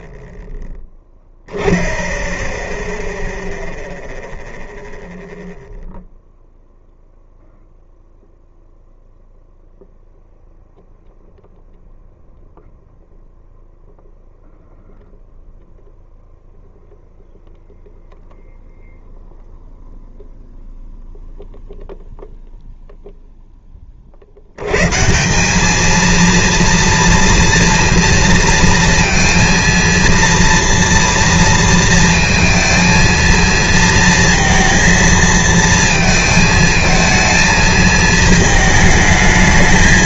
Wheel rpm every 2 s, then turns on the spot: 0, 0, 0, 0, 0, 0, 0, 0, 0, 0, 0, 20, 210, 230, 230, 230, 230, 230, 220, 220.
none